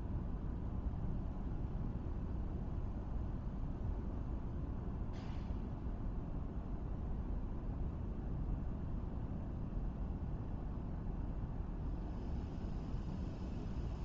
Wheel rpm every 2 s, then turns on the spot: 0, 0, 0, 0, 0, 0, 0.
none